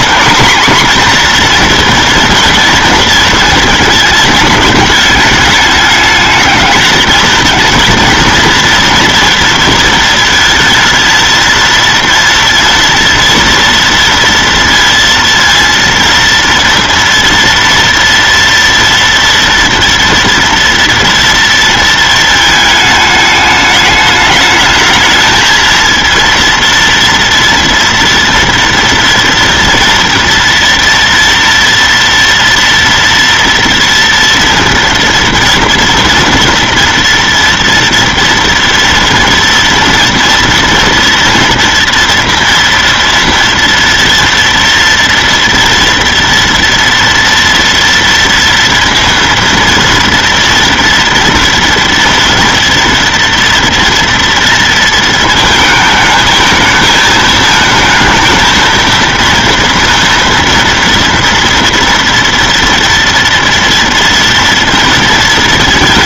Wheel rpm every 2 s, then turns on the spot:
240, 230, 220, 210, 230, 220, 230, 230, 230, 230, 230, 220, 210, 230, 230, 240, 230, 230, 230, 230, 230, 240, 230, 230, 230, 230, 230, 230, 220, 230, 230, 230, 230.
none